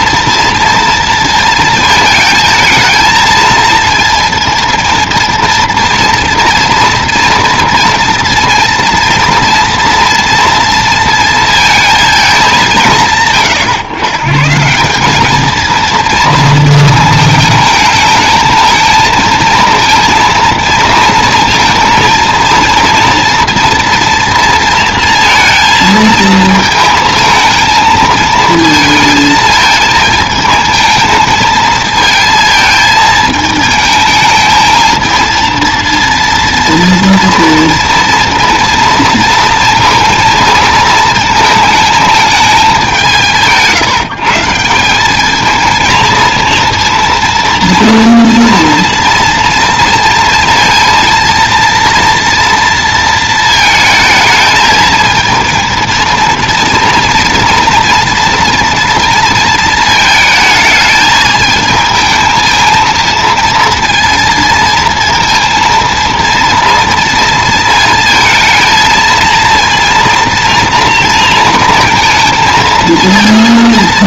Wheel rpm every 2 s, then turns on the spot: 230, 220, 230, 230, 230, 230, 150, 180, 220, 220, 230, 230, 230, 220, 220, 230, 220, 220, 230, 230, 220, 190, 190, 230, 230, 230, 230, 220, 230, 230, 220, 230, 230, 230, 220, 230, 230.
none